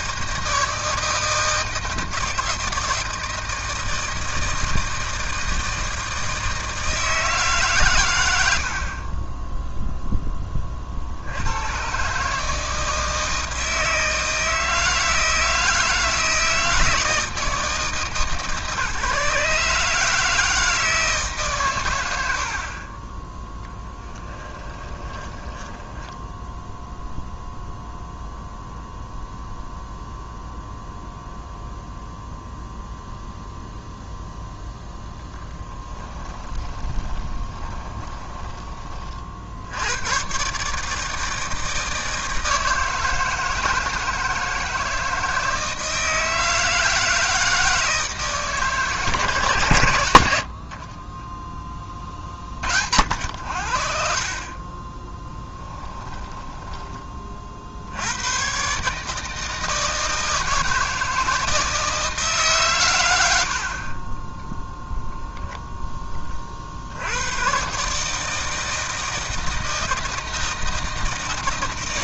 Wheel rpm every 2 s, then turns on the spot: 160, 160, 160, 160, 50, 40, 160, 160, 160, 150, 160, 40, 20, 0, 0, 0, 0, 0, 10, 30, 150, 160, 160, 160, 150, 60, 40, 20, 20, 140, 160, 110, 0, 50, 160, 160.
24-26 36-38